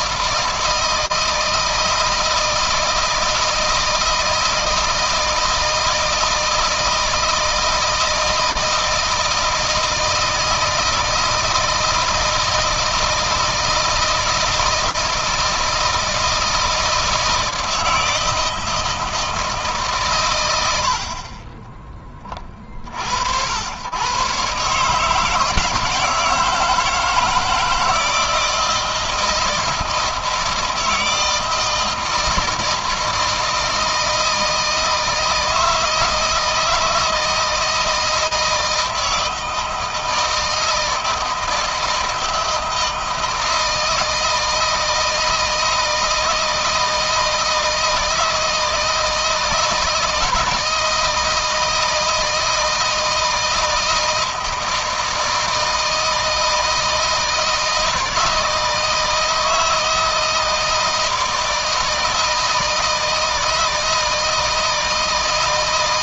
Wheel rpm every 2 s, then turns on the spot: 160, 160, 160, 160, 160, 160, 160, 160, 160, 160, 60, 50, 150, 160, 160, 160, 160, 160, 160, 160, 160, 160, 160, 160, 160, 160, 160, 160, 160, 160, 160, 160, 160.
none